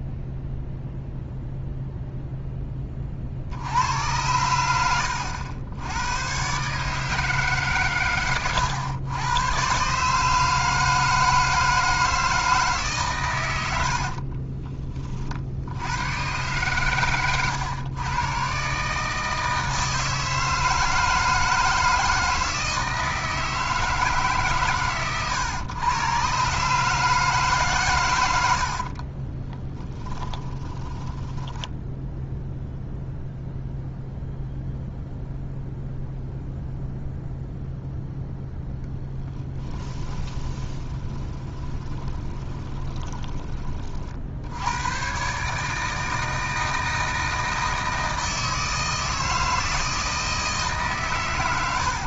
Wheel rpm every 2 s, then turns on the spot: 0, 20, 90, 150, 100, 160, 140, 40, 120, 140, 160, 160, 130, 150, 50, 20, 0, 0, 0, 10, 20, 20, 110, 160, 160, 140.
28-32 38-44